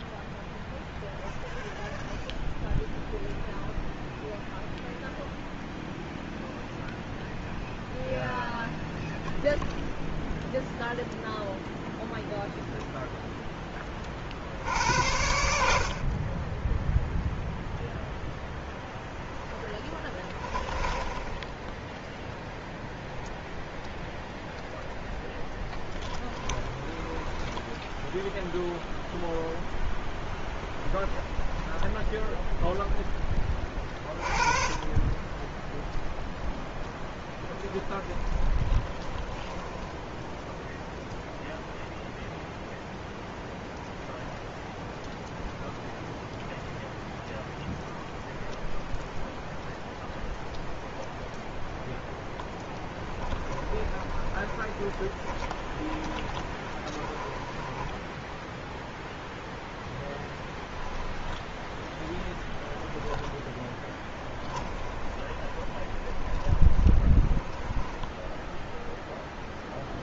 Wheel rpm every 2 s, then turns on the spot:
0, 0, 0, 0, 0, 0, 0, 80, 0, 0, 20, 10, 0, 20, 0, 20, 10, 20, 0, 10, 0, 0, 0, 0, 0, 0, 10, 10, 20, 0, 20, 10, 10, 10, 0.
20-22 26-28 30-32 38-40 52-58 60-68